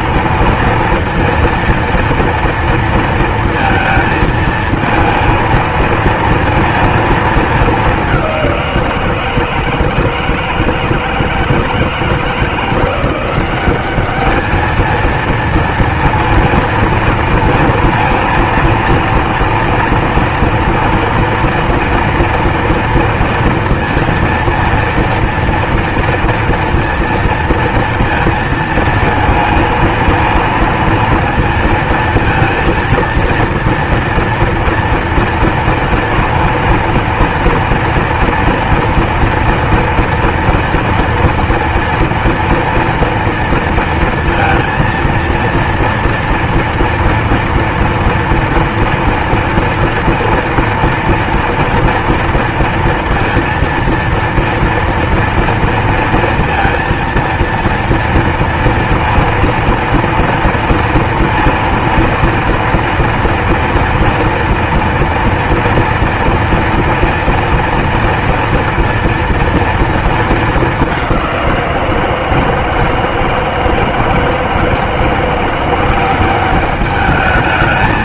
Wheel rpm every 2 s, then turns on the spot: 230, 230, 230, 230, 170, 160, 170, 220, 230, 230, 230, 230, 230, 230, 230, 230, 230, 240, 230, 230, 230, 230, 230, 230, 230, 230, 230, 230, 230, 230, 230, 230, 230, 230, 230, 200, 160, 160, 200.
none